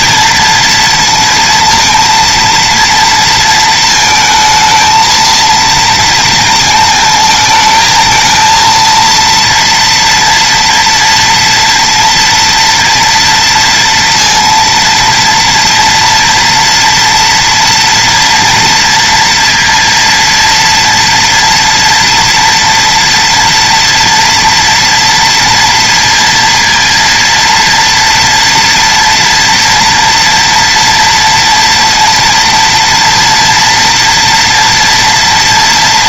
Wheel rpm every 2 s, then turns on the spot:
230, 230, 220, 230, 220, 230, 230, 230, 240, 240, 240, 230, 230, 230, 230, 230, 230, 230.
none